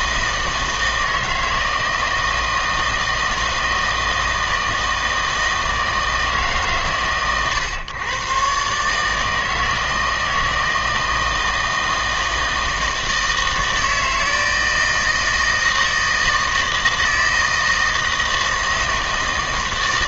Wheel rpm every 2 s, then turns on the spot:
160, 160, 160, 140, 140, 160, 160, 160, 160, 160.
none